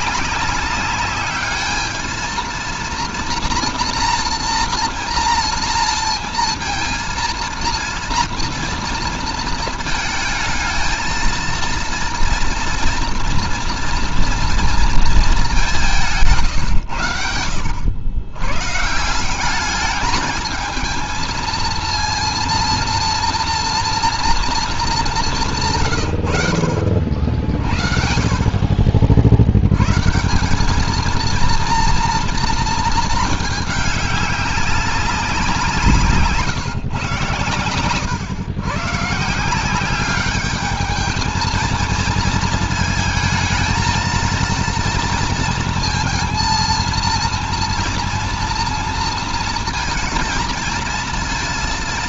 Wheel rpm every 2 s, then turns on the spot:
200, 220, 230, 230, 230, 220, 230, 230, 140, 120, 220, 230, 230, 80, 40, 190, 230, 200, 150, 130, 200, 220, 230, 230, 230, 220.
none